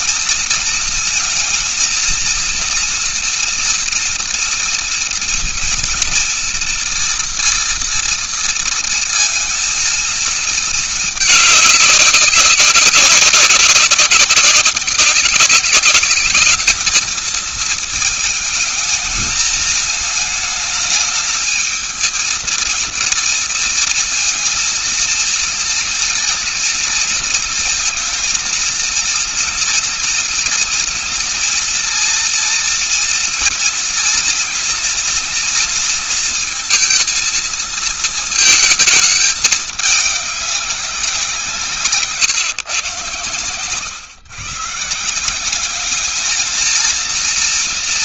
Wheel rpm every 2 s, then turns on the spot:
230, 230, 230, 230, 230, 220, 200, 200, 210, 220, 220, 230, 230, 230, 230, 240, 240, 230, 230, 220, 200, 140, 130, 220.
none